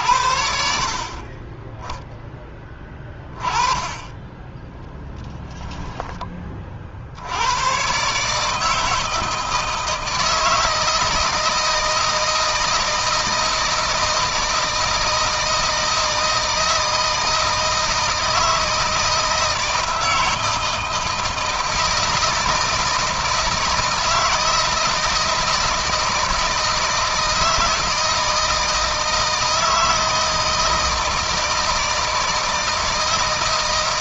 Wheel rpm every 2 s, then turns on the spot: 50, 20, 10, 50, 160, 160, 170, 160, 160, 160, 160, 160, 160, 160, 160, 160, 160.
4-6